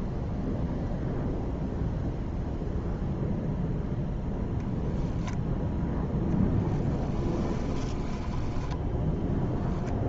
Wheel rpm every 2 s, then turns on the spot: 0, 0, 10, 10, 10.
4-6 8-10